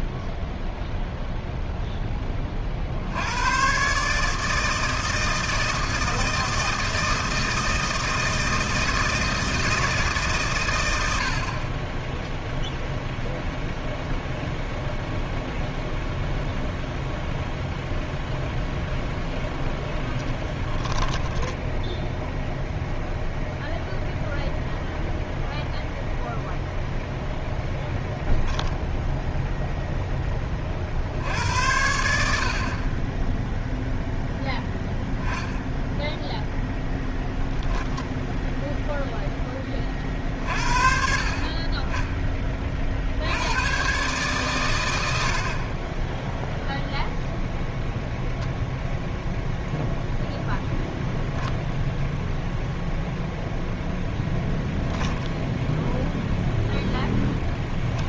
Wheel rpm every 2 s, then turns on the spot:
0, 40, 160, 160, 160, 110, 0, 0, 0, 0, 10, 0, 0, 0, 0, 40, 40, 0, 0, 0, 50, 30, 100, 0, 0, 0, 0, 0, 0.
20-22